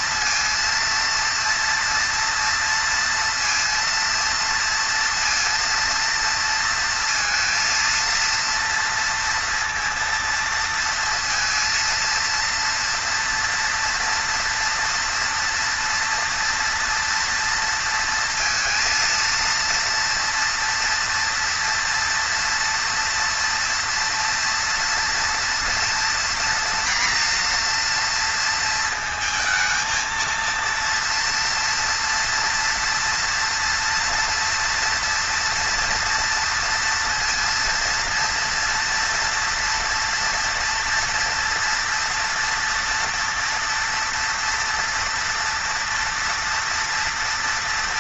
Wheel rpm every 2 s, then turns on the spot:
230, 230, 230, 230, 230, 230, 230, 230, 230, 230, 230, 230, 230, 240, 230, 230, 240, 230, 230, 230, 240, 230, 230, 230.
none